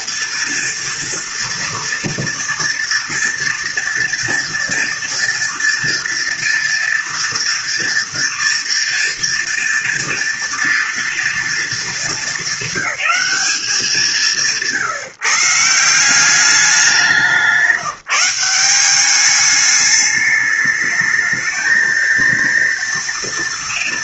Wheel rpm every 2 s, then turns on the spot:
230, 230, 230, 230, 230, 230, 200, 160, 190, 190, 210, 230.
none